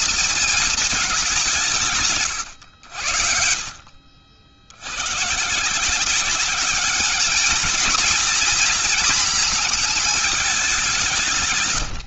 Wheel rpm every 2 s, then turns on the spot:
220, 110, 60, 190, 230, 210.
none